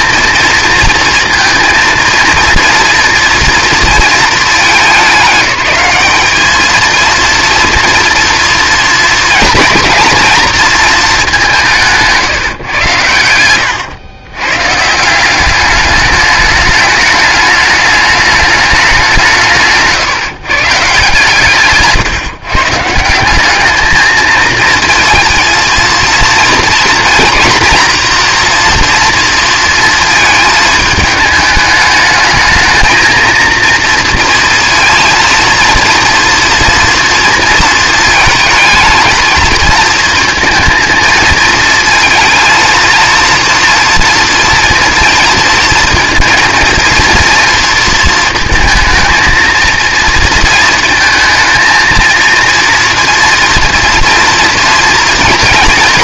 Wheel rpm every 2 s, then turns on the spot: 230, 230, 210, 220, 230, 230, 130, 130, 210, 210, 150, 150, 220, 230, 240, 220, 220, 230, 230, 220, 230, 220, 230, 230, 220, 220, 240, 230.
none